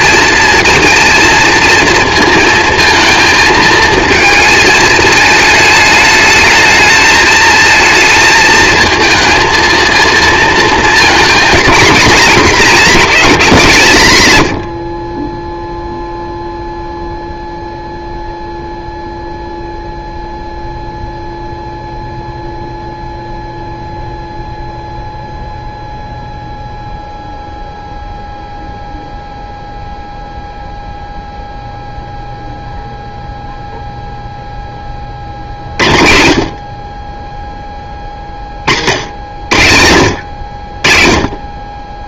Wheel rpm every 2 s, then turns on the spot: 230, 230, 220, 220, 220, 230, 240, 90, 0, 0, 0, 0, 0, 0, 0, 0, 0, 10, 30, 50, 40.
none